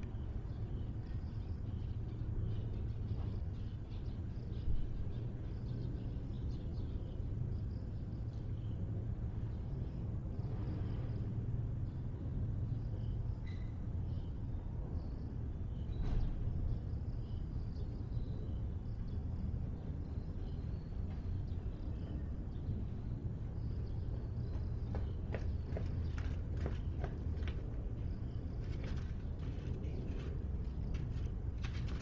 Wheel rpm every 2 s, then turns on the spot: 0, 0, 0, 0, 0, 0, 0, 0, 0, 0, 0, 0, 0, 0, 0, 0.
none